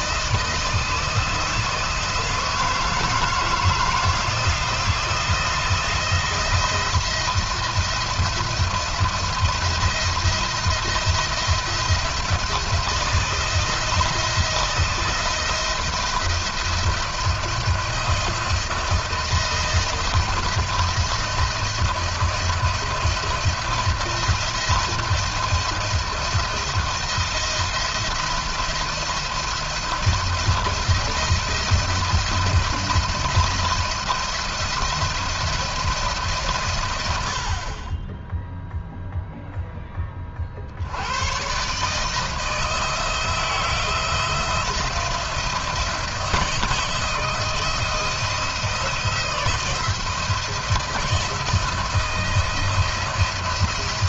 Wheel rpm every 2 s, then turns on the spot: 160, 160, 170, 170, 170, 170, 160, 170, 160, 160, 170, 170, 170, 170, 170, 170, 170, 170, 130, 0, 50, 160, 160, 170, 170, 170, 170.
none